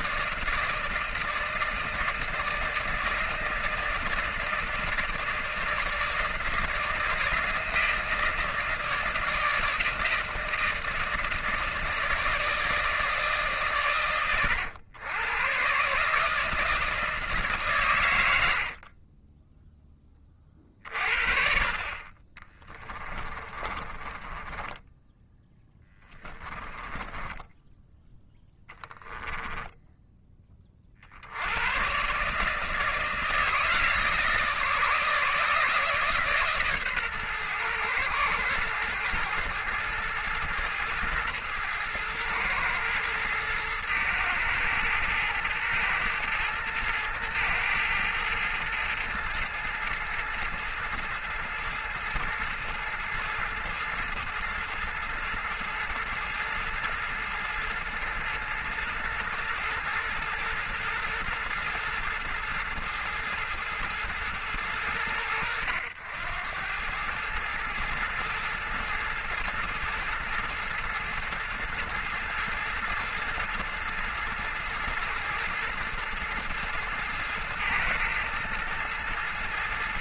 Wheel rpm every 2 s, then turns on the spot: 160, 160, 160, 160, 160, 160, 160, 110, 160, 40, 40, 30, 10, 10, 10, 40, 160, 150, 130, 110, 110, 110, 110, 110, 110, 110, 110, 110, 110, 110, 110, 110, 100, 100, 110, 110, 110, 110, 110, 110.
22-30